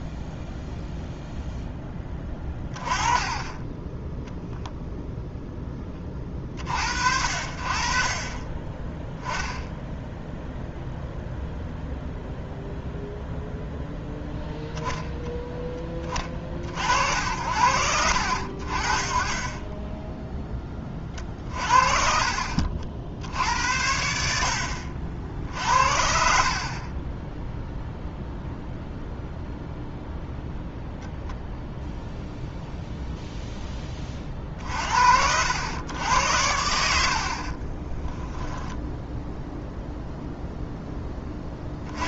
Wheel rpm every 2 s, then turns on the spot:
0, 20, 0, 50, 10, 0, 0, 0, 60, 50, 20, 50, 50, 30, 0, 0, 0, 50, 70, 10, 10.
26-28